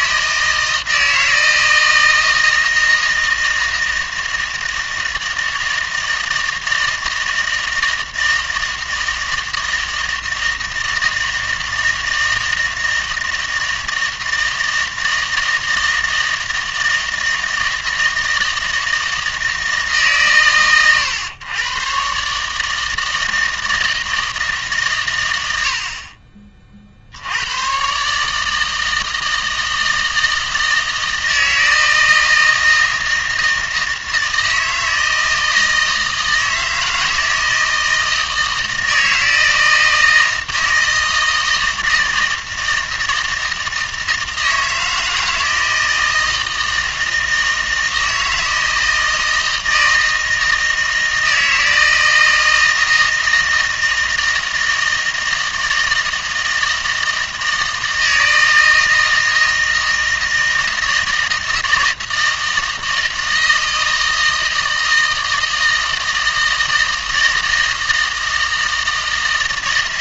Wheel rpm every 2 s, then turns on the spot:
160, 160, 160, 160, 160, 160, 160, 160, 160, 160, 100, 160, 140, 50, 160, 160, 160, 160, 160, 160, 160, 160, 160, 160, 160, 160, 160, 160, 160, 160, 160, 160, 160, 160, 160.
none